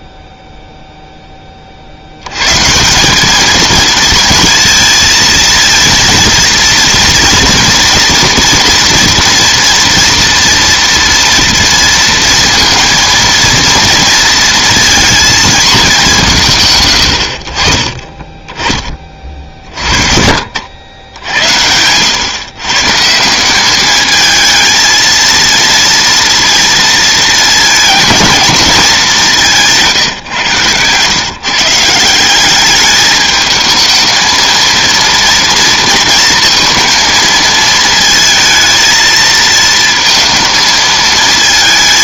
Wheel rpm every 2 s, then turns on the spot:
0, 140, 230, 230, 240, 230, 230, 230, 140, 20, 80, 140, 220, 230, 220, 130, 200, 230, 230, 230, 220.
none